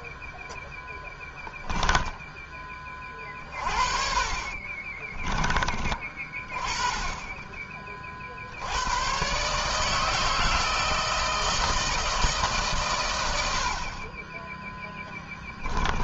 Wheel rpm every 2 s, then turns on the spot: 20, 10, 30, 30, 60, 160, 150, 20.
0-2 4-6